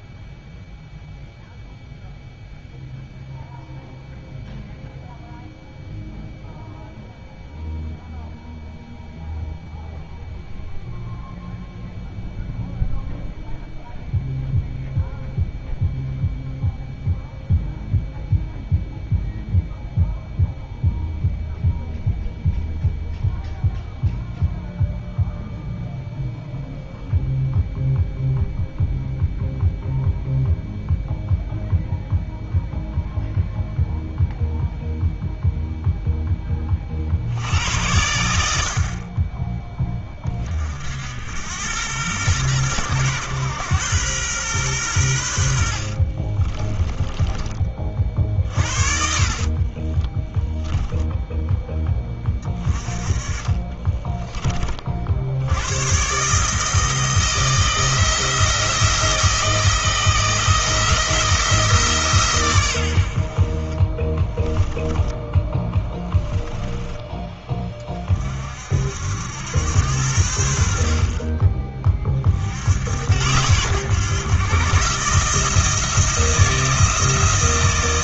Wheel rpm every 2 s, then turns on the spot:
0, 0, 0, 0, 0, 0, 0, 0, 0, 0, 0, 0, 0, 0, 0, 0, 0, 0, 60, 40, 70, 110, 90, 20, 60, 10, 30, 30, 160, 160, 170, 100, 10, 10, 50, 70, 70, 130, 160.
46-52 64-66